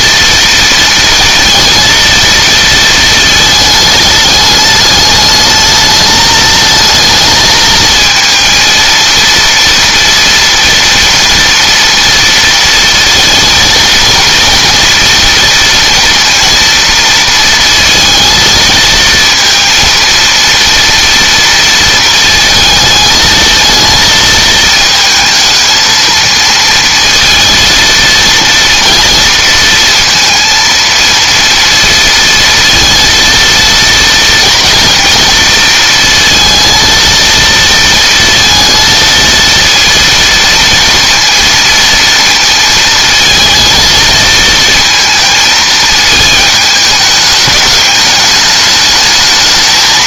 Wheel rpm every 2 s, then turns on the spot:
230, 230, 210, 220, 230, 230, 230, 240, 230, 220, 230, 220, 220, 230, 230, 230, 230, 230, 230, 230, 230, 220, 230, 210, 210.
none